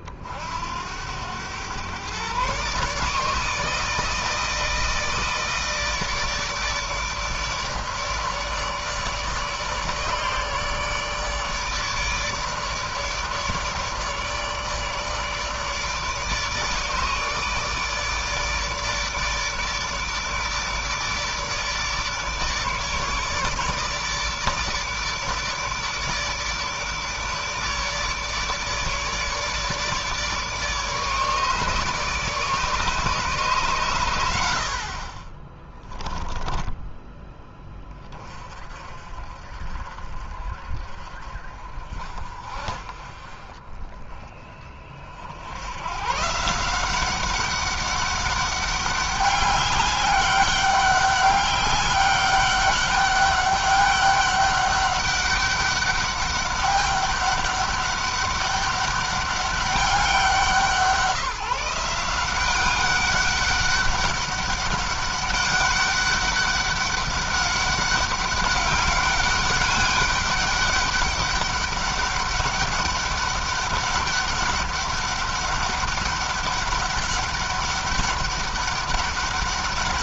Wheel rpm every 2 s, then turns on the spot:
80, 150, 160, 160, 150, 150, 150, 150, 150, 150, 150, 150, 150, 150, 150, 150, 150, 50, 20, 40, 40, 40, 50, 180, 200, 200, 200, 200, 200, 200, 170, 200, 200, 200, 200, 200, 200, 200, 200, 200.
none